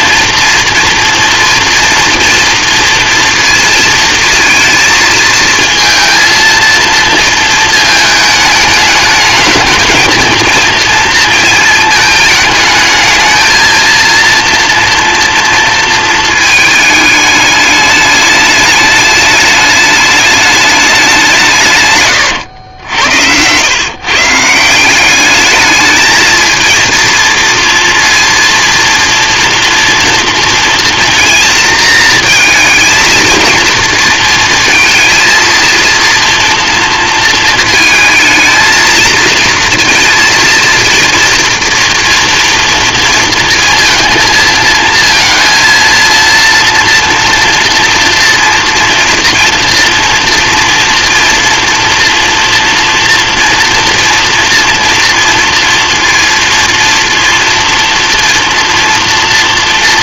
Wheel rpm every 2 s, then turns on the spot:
230, 230, 230, 230, 210, 220, 220, 230, 220, 210, 210, 90, 170, 230, 230, 230, 220, 230, 230, 220, 230, 230, 220, 230, 230, 230, 230, 230, 230, 240.
none